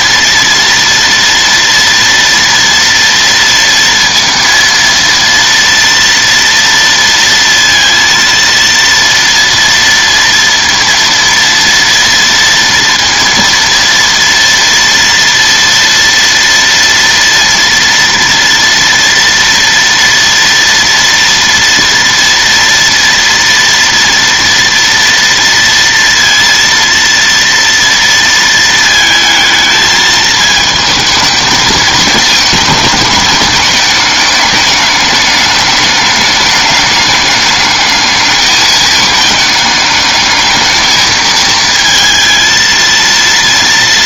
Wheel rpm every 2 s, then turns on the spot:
230, 230, 230, 230, 230, 230, 230, 230, 230, 230, 230, 230, 230, 230, 220, 220, 220, 210, 210, 210, 220, 230.
none